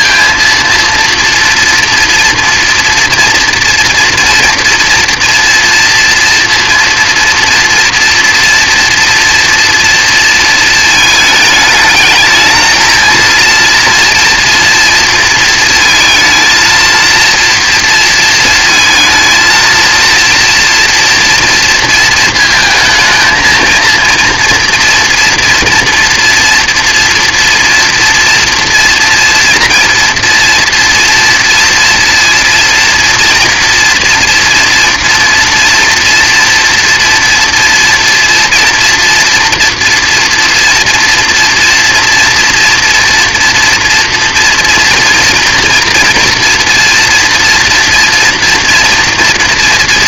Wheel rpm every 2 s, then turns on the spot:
230, 230, 230, 230, 230, 220, 220, 230, 230, 230, 230, 220, 230, 230, 230, 240, 230, 240, 230, 230, 230, 240, 230, 240, 230.
none